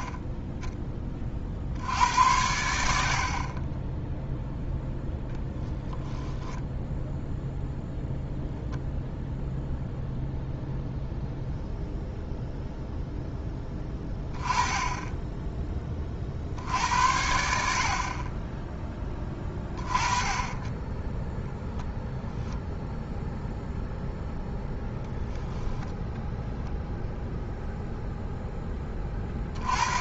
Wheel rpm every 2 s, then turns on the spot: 20, 70, 20, 10, 0, 0, 0, 10, 80, 20, 20, 0, 0, 0, 20.
4-8